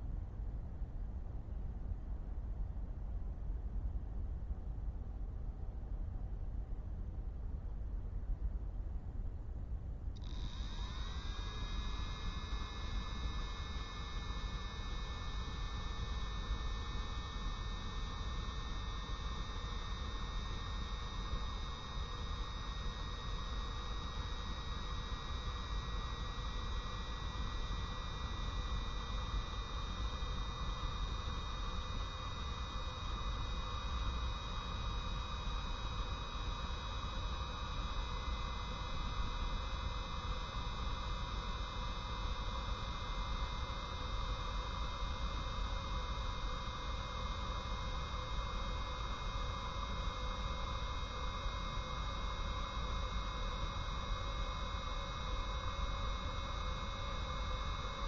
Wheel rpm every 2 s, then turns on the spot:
0, 0, 0, 0, 0, 0, 0, 0, 0, 0, 0, 0, 0, 0, 0, 0, 0, 0, 0, 0, 0, 0, 0, 0, 0, 0, 0, 0, 0.
none